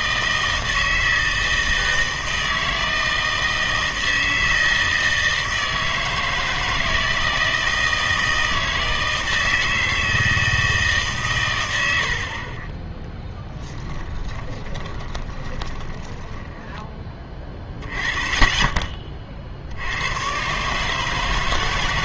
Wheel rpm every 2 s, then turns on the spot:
160, 160, 160, 160, 160, 160, 30, 20, 20, 20, 140.
14-18